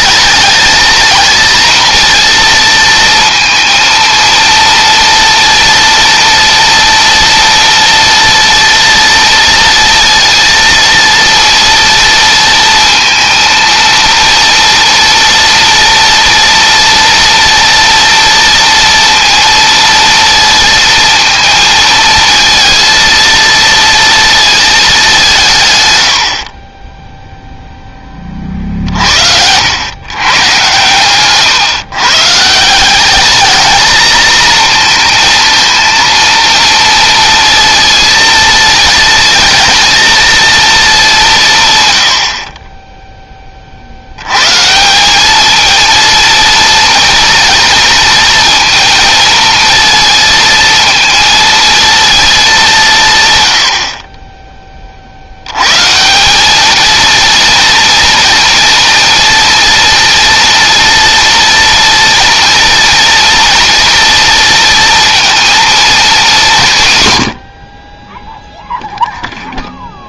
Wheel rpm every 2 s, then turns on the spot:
220, 230, 230, 240, 230, 230, 230, 230, 230, 230, 230, 230, 220, 40, 50, 130, 170, 230, 230, 230, 220, 30, 140, 230, 230, 230, 190, 20, 210, 230, 230, 230, 230, 180, 0.
none